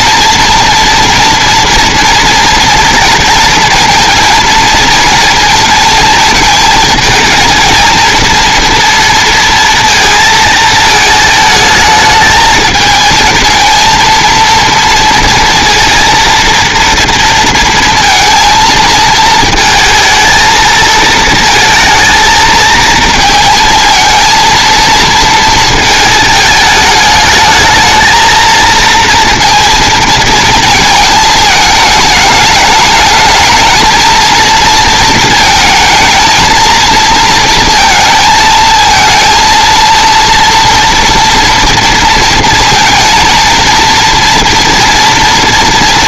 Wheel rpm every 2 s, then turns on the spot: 230, 230, 230, 220, 230, 220, 220, 230, 230, 230, 230, 230, 230, 210, 220, 220, 210, 230, 230, 220, 230, 230, 230.
none